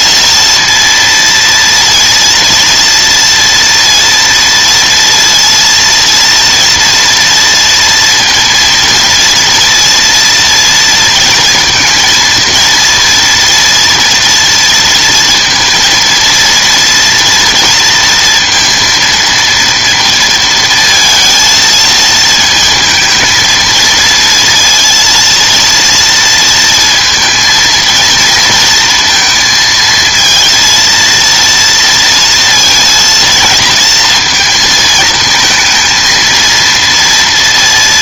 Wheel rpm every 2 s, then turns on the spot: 230, 230, 230, 240, 230, 230, 230, 230, 230, 230, 230, 220, 230, 230, 230, 230, 230, 230, 230.
none